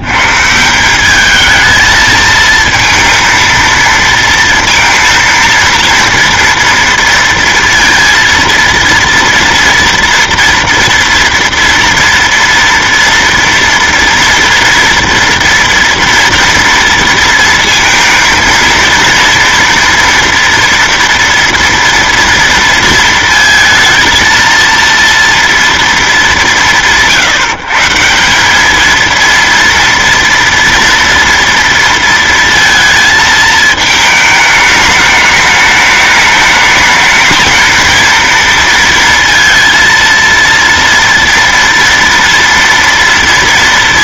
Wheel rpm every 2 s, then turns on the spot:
190, 230, 230, 230, 230, 240, 230, 230, 230, 230, 230, 230, 230, 170, 220, 230, 230, 210, 220, 230, 230, 230.
none